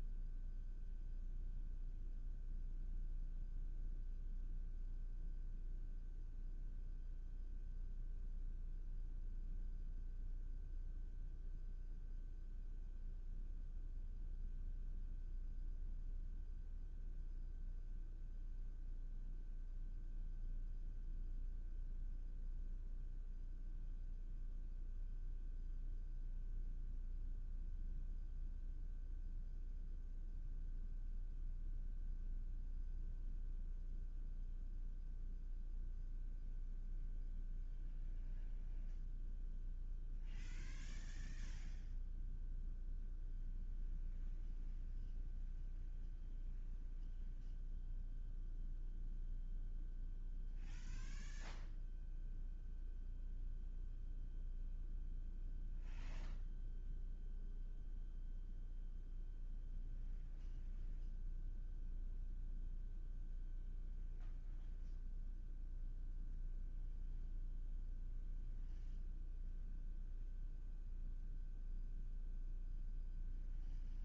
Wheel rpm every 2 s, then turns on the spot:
0, 0, 0, 0, 0, 0, 0, 0, 0, 0, 0, 0, 0, 0, 0, 0, 0, 0, 0, 0, 0, 0, 0, 0, 0, 0, 0, 0, 0, 0, 0, 0, 0, 0, 0, 0, 0.
none